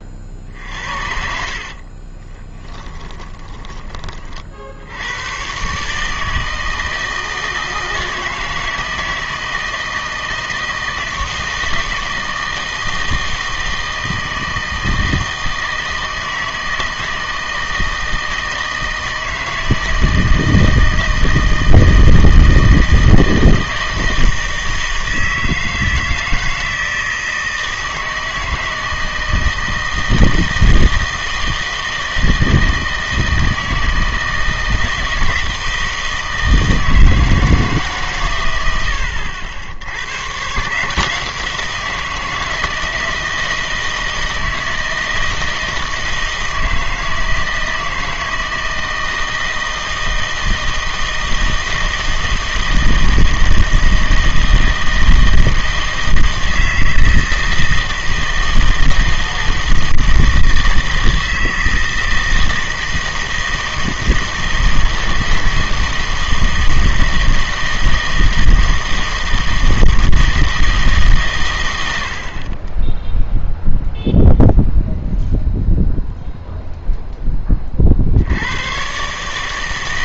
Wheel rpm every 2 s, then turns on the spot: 50, 20, 60, 160, 160, 160, 160, 160, 160, 160, 160, 160, 160, 160, 160, 160, 160, 160, 160, 90, 140, 160, 160, 160, 160, 160, 160, 160, 160, 160, 160, 160, 160, 160, 160, 160, 30, 0, 0, 90.
0-4